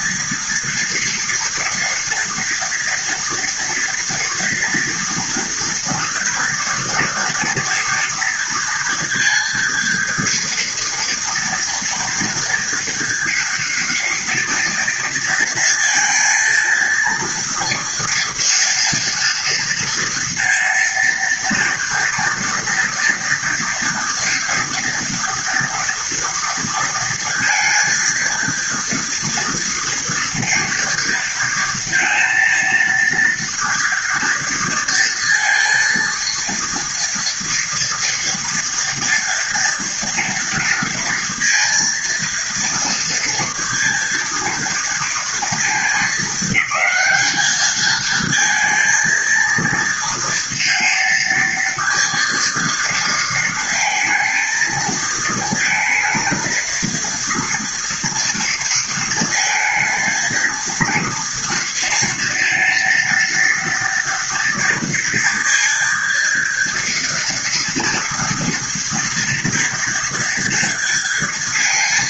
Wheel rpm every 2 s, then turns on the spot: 230, 230, 240, 230, 230, 230, 230, 230, 230, 230, 230, 230, 230, 230, 230, 230, 230, 230, 230, 230, 230, 230, 230, 210, 230, 230, 230, 220, 230, 230, 230, 230, 230, 230, 230, 230.
none